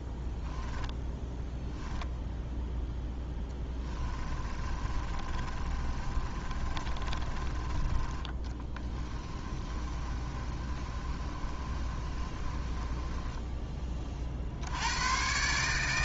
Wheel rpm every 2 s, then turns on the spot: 10, 0, 30, 30, 20, 30, 20, 90.
0-2 4-14